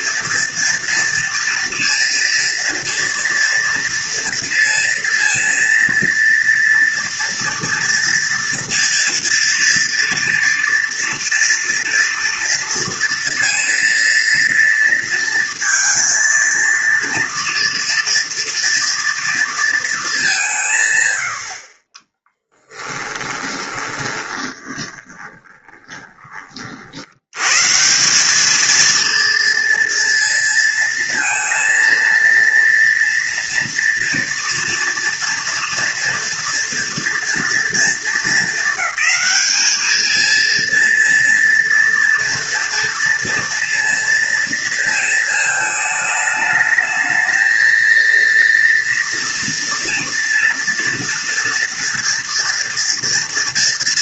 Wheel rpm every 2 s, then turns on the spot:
230, 240, 230, 230, 230, 230, 230, 230, 230, 230, 170, 10, 20, 40, 220, 230, 230, 230, 230, 220, 230, 230, 230, 220, 230, 230, 240.
22-26